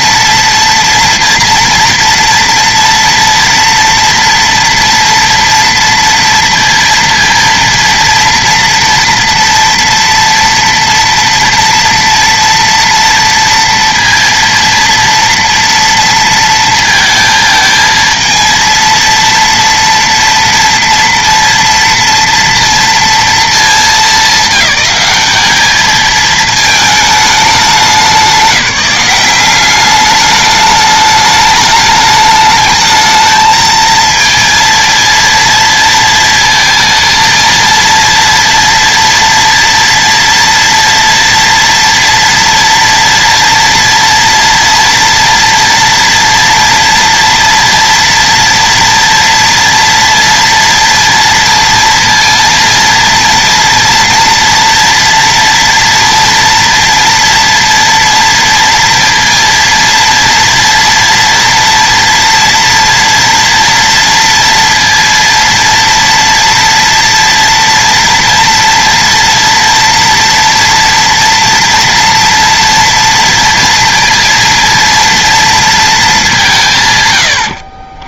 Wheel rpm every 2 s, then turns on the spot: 230, 230, 230, 230, 230, 230, 230, 230, 230, 230, 230, 230, 200, 220, 180, 210, 210, 230, 230, 230, 230, 230, 230, 240, 230, 230, 230, 230, 230, 230, 230, 230, 230, 230, 230, 230, 230, 230, 150.
none